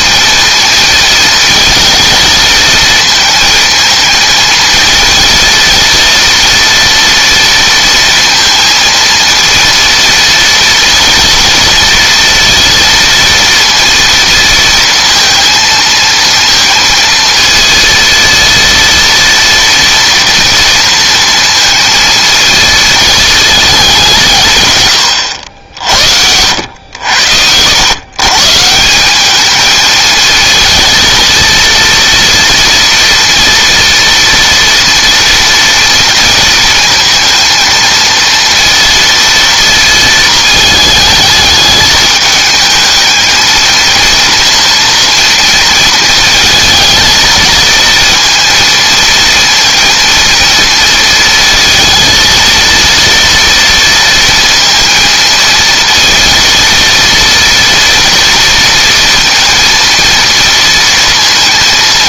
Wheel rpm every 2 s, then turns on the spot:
230, 220, 220, 230, 230, 230, 230, 230, 230, 230, 230, 220, 130, 90, 160, 230, 230, 230, 220, 230, 220, 220, 230, 220, 230, 230, 230, 230, 230, 230, 230.
none